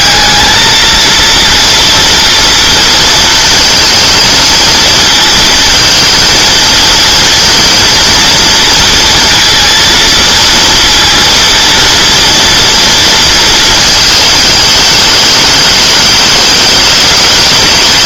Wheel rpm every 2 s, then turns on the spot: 230, 230, 230, 230, 230, 230, 230, 220, 210.
none